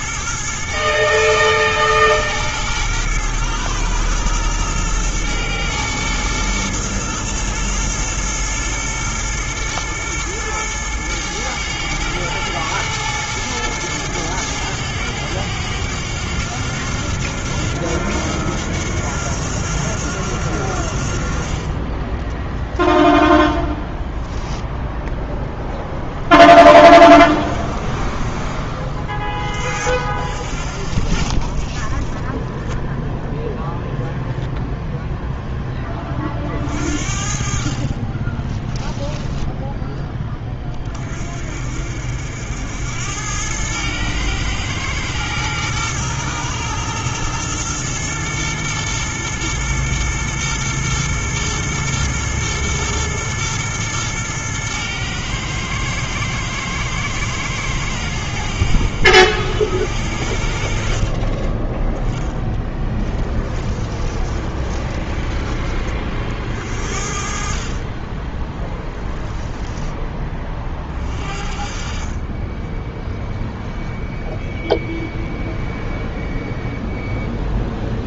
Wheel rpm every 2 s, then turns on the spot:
110, 110, 120, 110, 110, 110, 110, 100, 90, 90, 80, 0, 0, 30, 30, 50, 10, 0, 40, 10, 20, 80, 110, 110, 110, 120, 120, 110, 110, 80, 60, 10, 20, 50, 10, 20, 10, 0, 0.
38-40 62-66 68-70